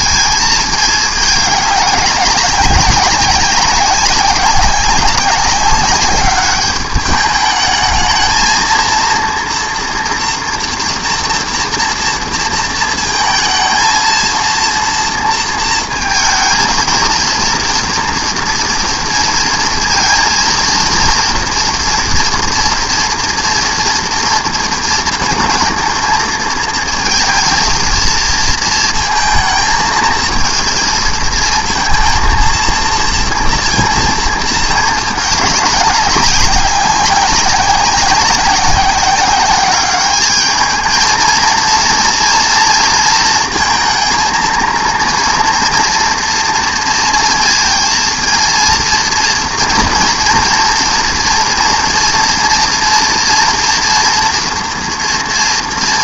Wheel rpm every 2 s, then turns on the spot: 220, 190, 190, 210, 230, 240, 230, 230, 220, 230, 230, 230, 230, 230, 220, 220, 230, 220, 190, 190, 210, 230, 230, 230, 230, 230, 240, 230.
none